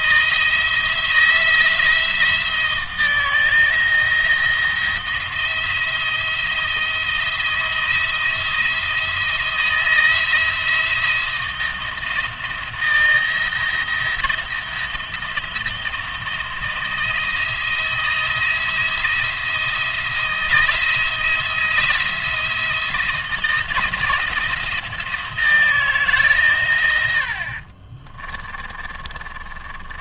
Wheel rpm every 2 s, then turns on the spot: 170, 170, 170, 170, 170, 160, 170, 170, 170, 170, 170, 160, 170, 90, 30.
28-30